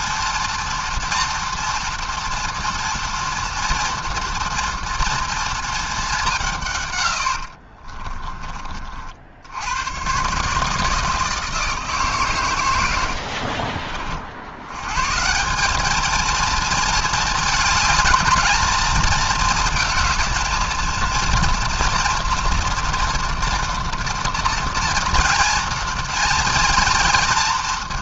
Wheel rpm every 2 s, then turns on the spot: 240, 240, 240, 150, 40, 150, 100, 100, 220, 230, 230, 230, 230, 230.
none